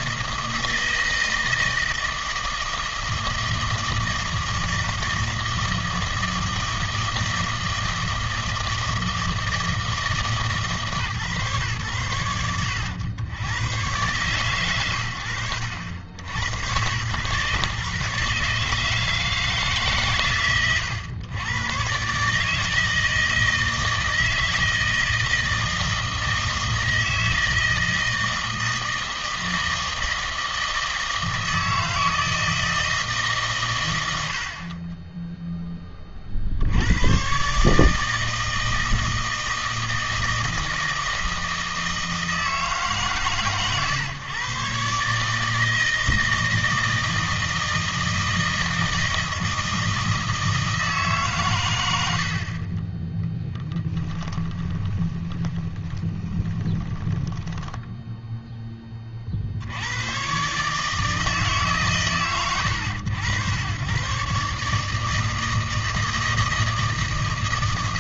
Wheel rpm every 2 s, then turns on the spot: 160, 160, 160, 160, 160, 150, 100, 110, 90, 150, 120, 160, 160, 160, 160, 160, 160, 50, 70, 160, 160, 160, 130, 160, 160, 160, 50, 20, 10, 10, 140, 100, 150, 160.
54-58